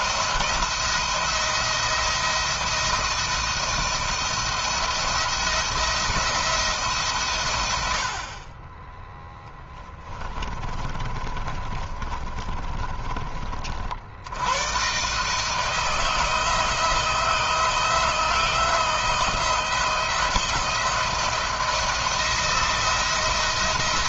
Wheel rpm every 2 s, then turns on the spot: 170, 170, 170, 150, 10, 30, 30, 130, 170, 170, 170, 170.
10-12